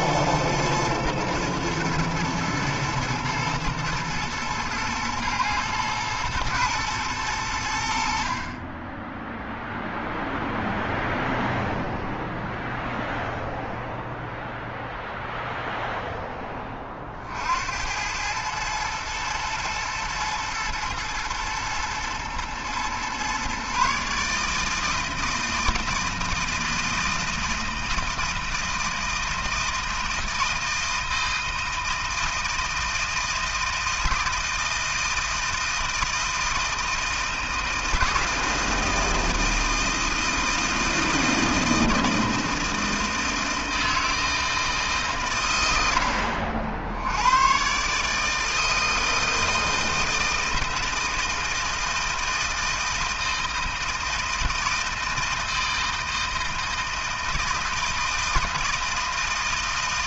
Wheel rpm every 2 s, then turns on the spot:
110, 110, 120, 110, 20, 0, 0, 0, 20, 110, 120, 120, 160, 160, 160, 160, 160, 160, 160, 160, 160, 160, 160, 70, 160, 160, 160, 160, 160, 160.
none